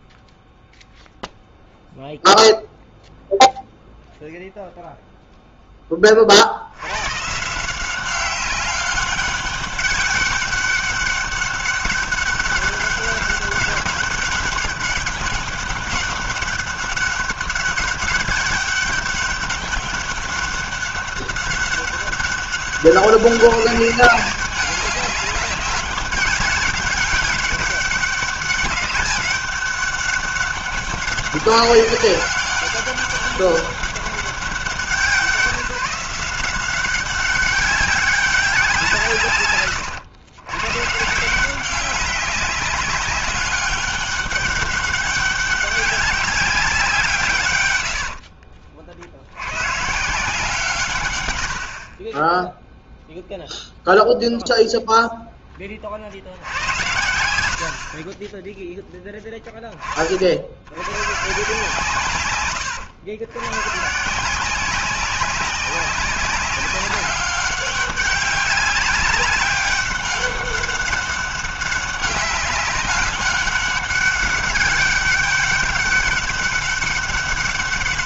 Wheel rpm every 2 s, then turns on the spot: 0, 0, 0, 100, 190, 200, 200, 200, 200, 200, 200, 190, 200, 200, 200, 200, 200, 170, 190, 170, 140, 190, 200, 170, 70, 120, 0, 0, 80, 10, 120, 100, 180, 190, 200, 200, 200, 200, 200.
none